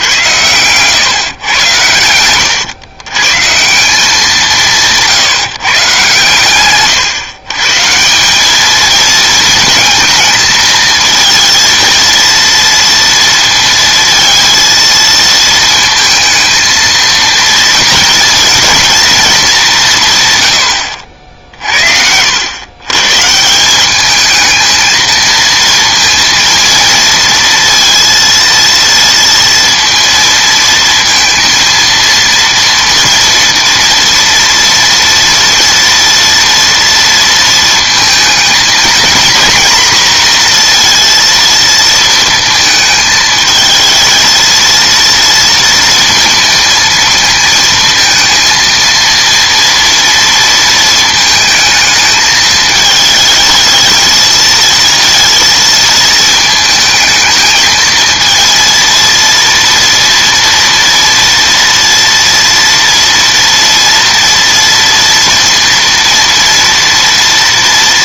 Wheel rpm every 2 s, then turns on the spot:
110, 110, 170, 120, 210, 220, 230, 230, 220, 230, 100, 120, 220, 230, 230, 230, 230, 230, 240, 220, 230, 220, 230, 230, 230, 230, 220, 230, 220, 230, 230, 240, 230, 230.
0-2